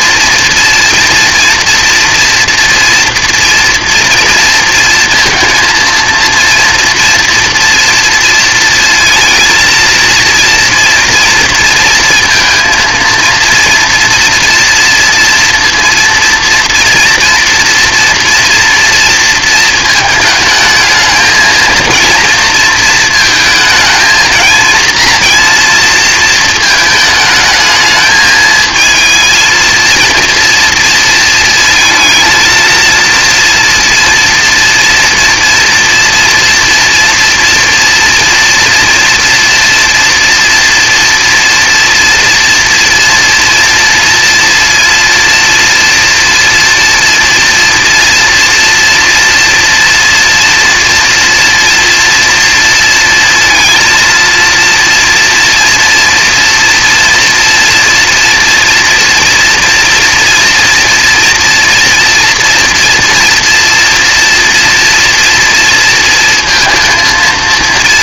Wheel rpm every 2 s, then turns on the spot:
230, 230, 230, 230, 230, 240, 220, 230, 230, 230, 220, 230, 230, 220, 220, 230, 230, 230, 230, 240, 230, 230, 230, 240, 230, 230, 230, 230, 230, 230, 230, 230, 230, 220.
none